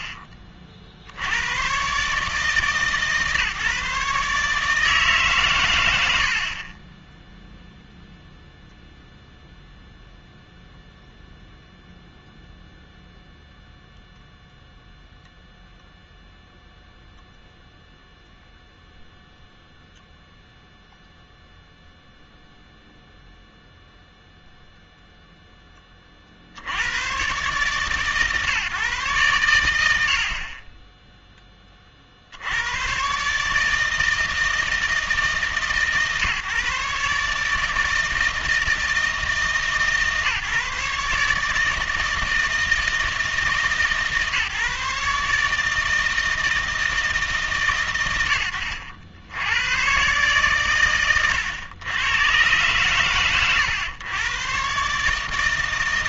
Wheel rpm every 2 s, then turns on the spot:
50, 150, 150, 40, 0, 0, 0, 0, 0, 0, 0, 0, 0, 70, 140, 30, 100, 160, 140, 160, 150, 160, 140, 160, 90, 130, 120, 130.
none